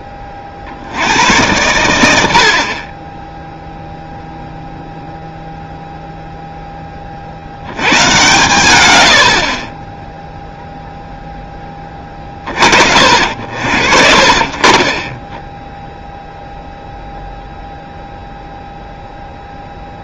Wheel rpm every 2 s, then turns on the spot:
70, 40, 0, 20, 100, 0, 50, 30, 0, 0.
none